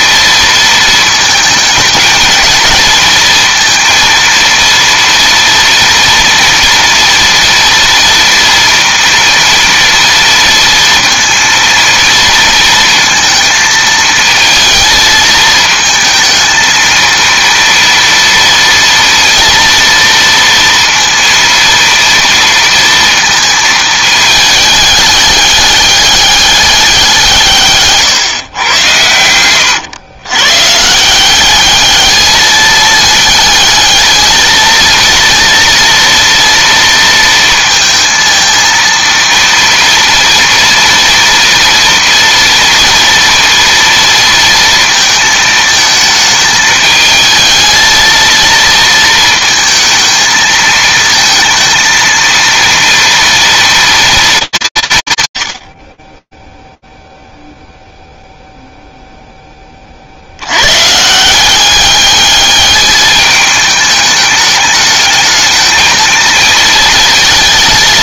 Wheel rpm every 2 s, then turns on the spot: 230, 220, 230, 230, 230, 230, 230, 220, 220, 230, 230, 230, 210, 200, 120, 130, 210, 220, 230, 230, 240, 230, 230, 220, 230, 220, 230, 180, 10, 0, 120, 210, 210, 220.
none